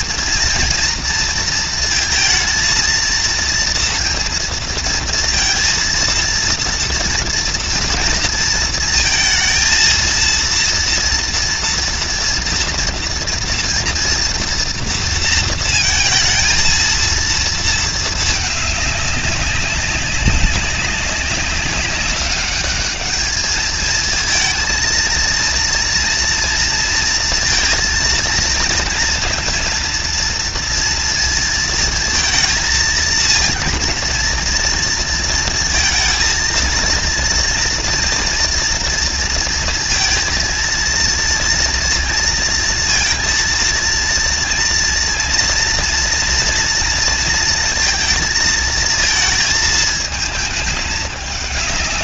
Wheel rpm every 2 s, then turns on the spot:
230, 230, 230, 230, 230, 230, 230, 230, 230, 200, 190, 210, 230, 230, 230, 230, 220, 230, 230, 230, 230, 230, 240, 230, 220, 210.
none